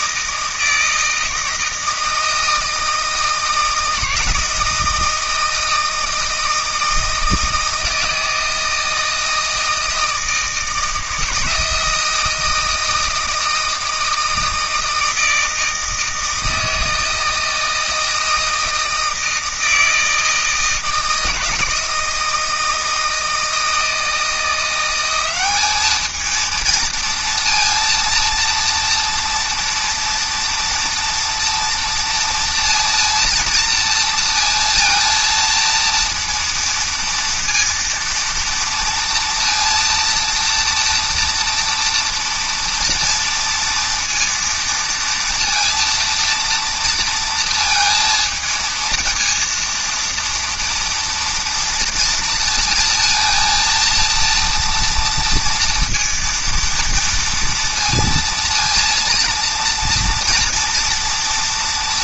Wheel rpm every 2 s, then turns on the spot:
160, 160, 160, 160, 160, 160, 160, 160, 160, 160, 160, 160, 170, 230, 230, 230, 230, 230, 230, 230, 230, 230, 230, 230, 230, 230, 230, 230, 230, 230, 230.
none